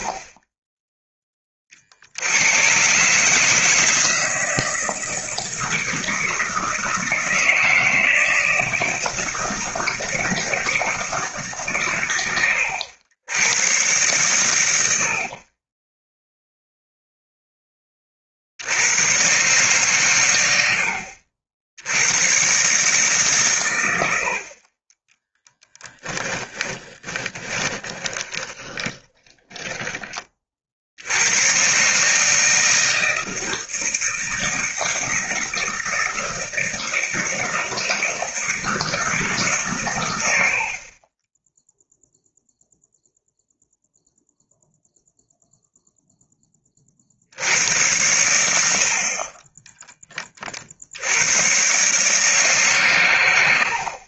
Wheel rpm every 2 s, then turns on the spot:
10, 130, 160, 160, 160, 160, 90, 90, 0, 90, 70, 140, 20, 20, 20, 80, 160, 160, 170, 160, 30, 0, 0, 40, 50, 70, 130.
26-30